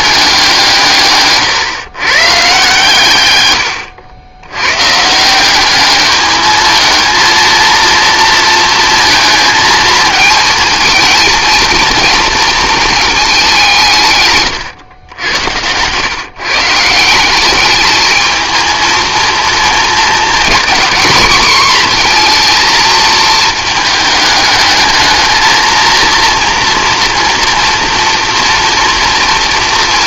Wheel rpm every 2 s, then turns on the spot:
160, 150, 120, 220, 230, 220, 230, 120, 160, 230, 240, 230, 220, 230, 240.
14-16